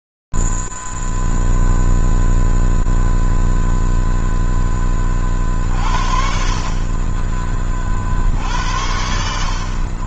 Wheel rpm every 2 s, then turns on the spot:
0, 0, 0, 50, 50.
none